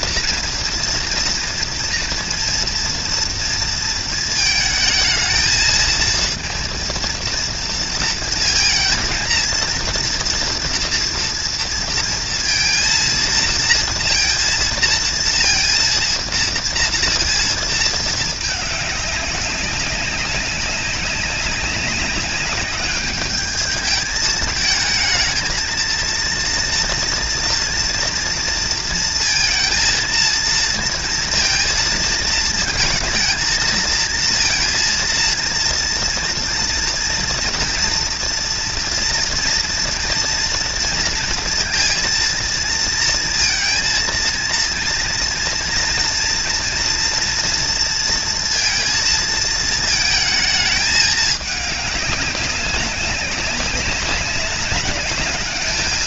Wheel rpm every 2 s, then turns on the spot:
230, 230, 220, 230, 230, 230, 230, 230, 230, 210, 190, 200, 220, 240, 230, 230, 220, 230, 230, 230, 230, 230, 230, 240, 230, 220, 190, 200.
none